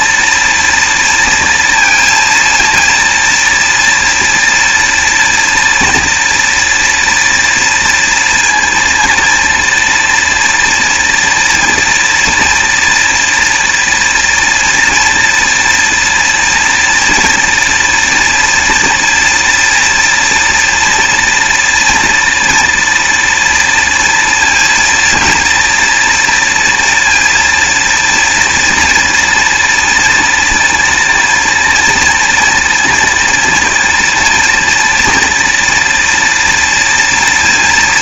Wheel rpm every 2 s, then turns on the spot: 230, 230, 230, 230, 230, 230, 230, 230, 240, 230, 230, 230, 230, 230, 230, 230, 230, 240, 230.
none